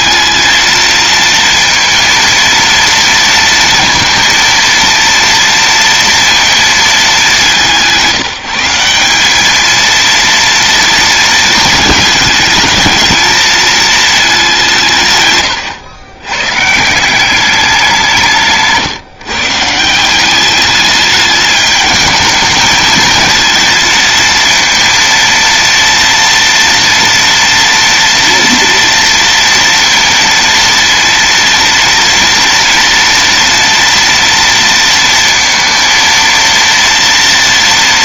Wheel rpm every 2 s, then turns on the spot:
220, 230, 230, 230, 170, 230, 220, 190, 130, 160, 200, 220, 230, 230, 230, 230, 230, 230, 230.
none